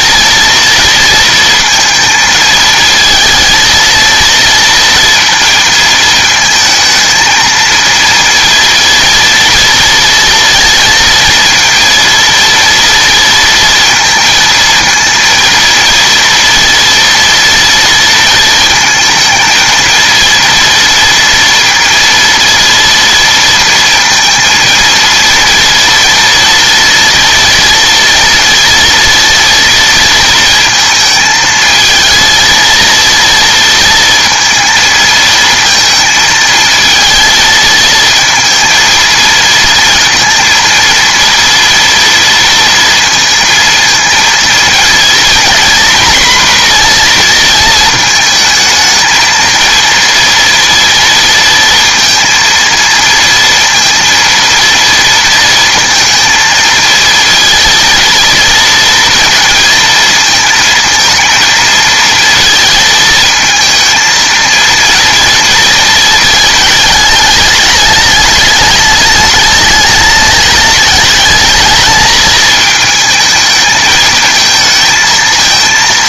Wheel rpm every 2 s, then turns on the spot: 230, 220, 230, 220, 230, 230, 230, 230, 230, 230, 230, 230, 230, 230, 230, 230, 230, 220, 220, 220, 230, 230, 230, 240, 220, 230, 230, 230, 230, 230, 230, 230, 230, 210, 210, 210, 220, 220.
none